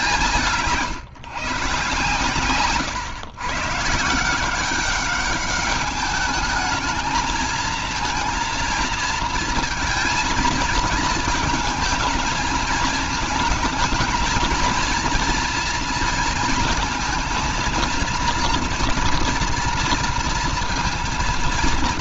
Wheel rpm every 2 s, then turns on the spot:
150, 130, 190, 210, 230, 230, 220, 220, 230, 230, 230.
none